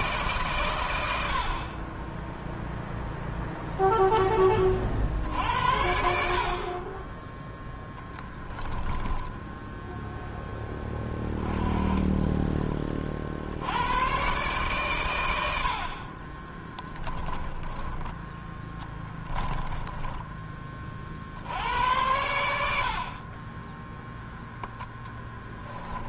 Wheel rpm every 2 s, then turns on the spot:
90, 0, 50, 20, 10, 10, 40, 110, 20, 20, 40, 50, 10.
8-10 16-20 24-26